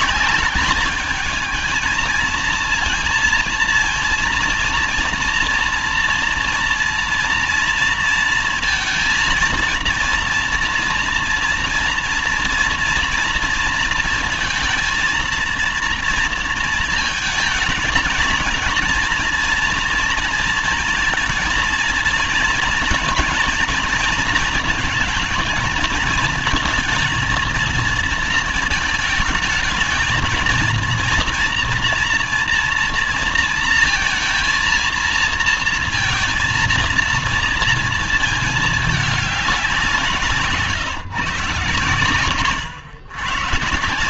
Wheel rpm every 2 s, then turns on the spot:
210, 230, 230, 230, 230, 230, 230, 230, 230, 230, 230, 230, 220, 230, 220, 230, 230, 230, 230, 220, 150, 120.
none